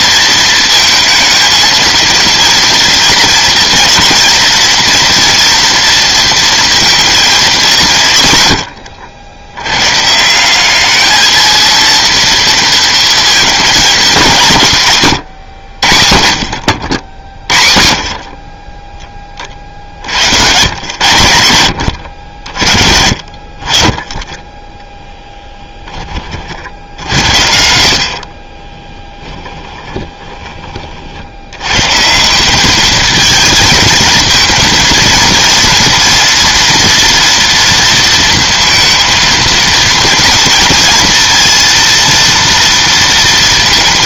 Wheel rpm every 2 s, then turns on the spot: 230, 230, 230, 230, 100, 200, 230, 160, 60, 20, 110, 60, 10, 60, 20, 30, 210, 230, 230, 230, 230, 230.
28-30